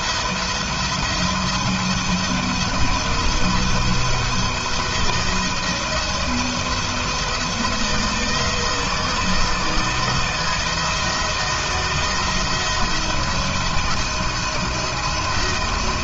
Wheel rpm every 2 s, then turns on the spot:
170, 170, 160, 170, 160, 170, 160, 160.
none